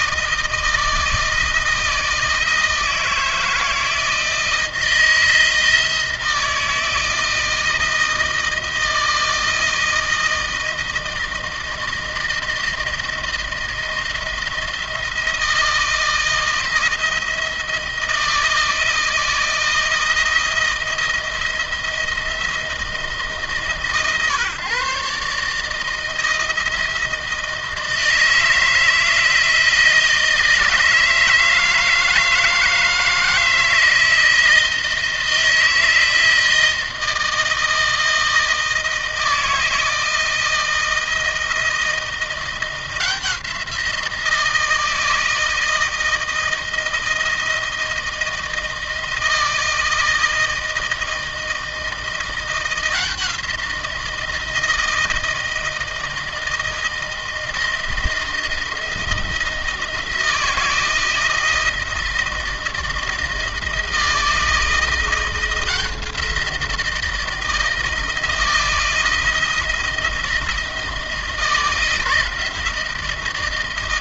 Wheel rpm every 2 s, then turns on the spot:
160, 160, 160, 160, 160, 160, 170, 170, 170, 160, 160, 160, 140, 160, 160, 160, 160, 160, 160, 160, 160, 170, 160, 160, 160, 160, 170, 160, 160, 170, 170, 160, 170, 170, 160, 160, 170.
none